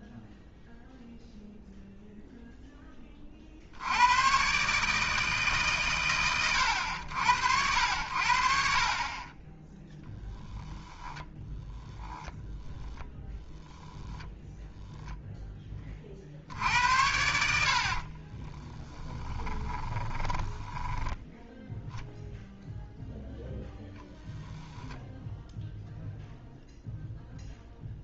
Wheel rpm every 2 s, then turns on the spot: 0, 0, 140, 100, 50, 10, 10, 0, 80, 20, 10, 0, 10, 0.
10-14 18-22 24-26